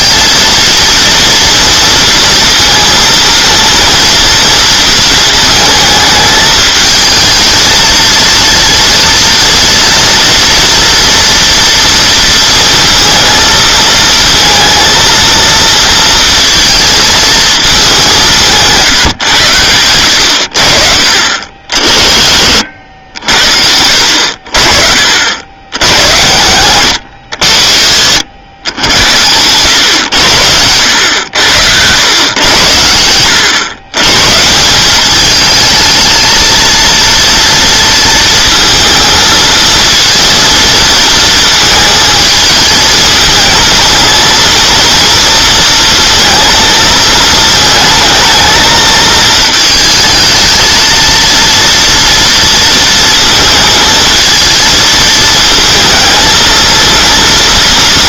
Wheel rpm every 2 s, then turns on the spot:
230, 230, 230, 220, 230, 230, 230, 230, 220, 160, 50, 60, 50, 110, 90, 90, 110, 180, 230, 230, 230, 220, 230, 220, 220, 220, 230, 230, 230.
22-24